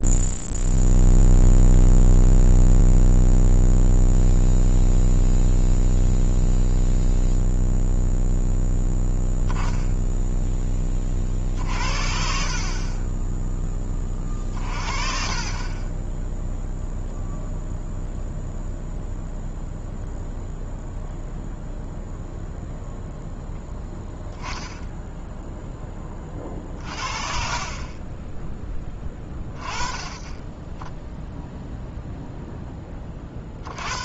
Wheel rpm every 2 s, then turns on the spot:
0, 0, 0, 0, 0, 20, 40, 40, 0, 0, 0, 0, 10, 40, 10, 10, 20.
14-16